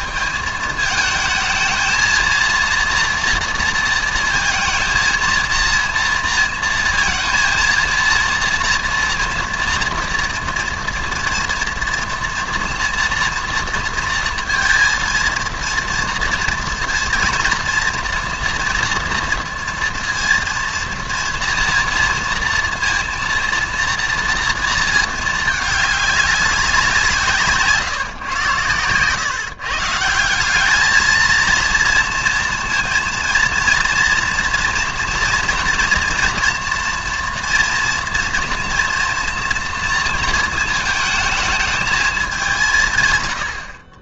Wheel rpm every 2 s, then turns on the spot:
220, 230, 230, 230, 230, 230, 230, 230, 230, 230, 230, 230, 230, 190, 110, 190, 230, 230, 230, 240, 230, 180.
none